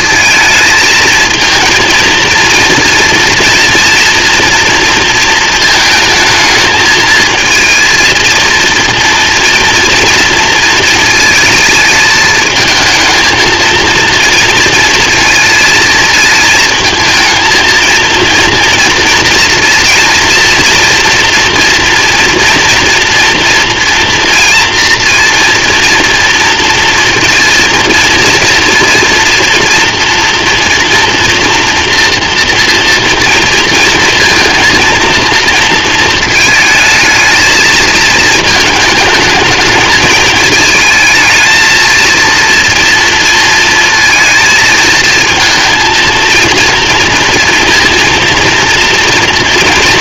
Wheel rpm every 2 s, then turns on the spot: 220, 230, 230, 220, 230, 230, 220, 230, 220, 230, 230, 230, 230, 230, 230, 240, 230, 230, 220, 220, 220, 230, 220, 230, 230.
none